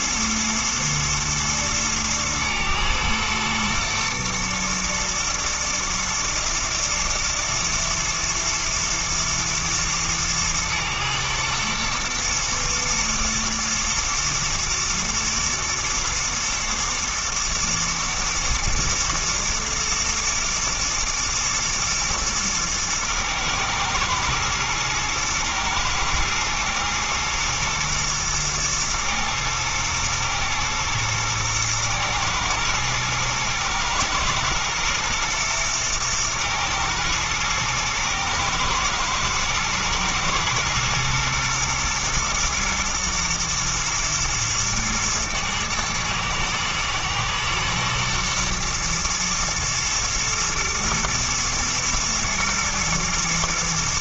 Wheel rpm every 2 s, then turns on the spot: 110, 120, 120, 110, 110, 110, 120, 110, 110, 110, 110, 110, 110, 110, 110, 110, 110, 120, 110, 120, 120, 110, 120, 110, 120, 120, 110.
none